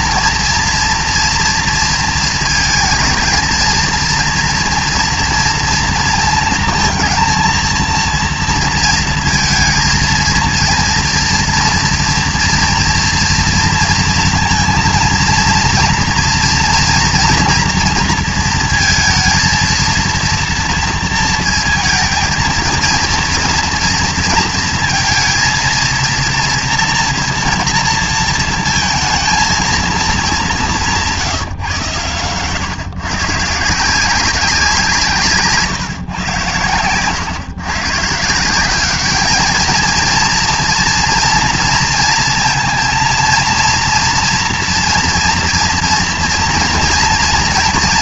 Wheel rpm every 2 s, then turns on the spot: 230, 230, 230, 230, 230, 230, 230, 230, 230, 230, 230, 230, 220, 230, 230, 200, 140, 190, 120, 180, 230, 230, 230, 240.
none